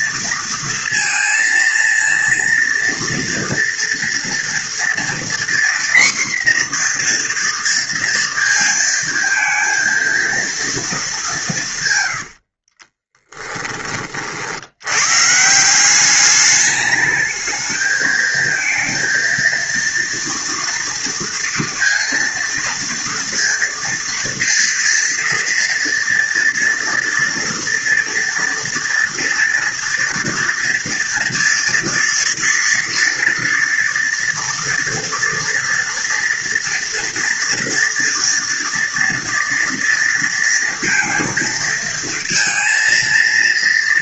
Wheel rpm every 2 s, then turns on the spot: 230, 230, 230, 250, 230, 230, 60, 70, 210, 220, 230, 230, 230, 230, 230, 230, 230, 230, 230, 230, 230, 230.
12-14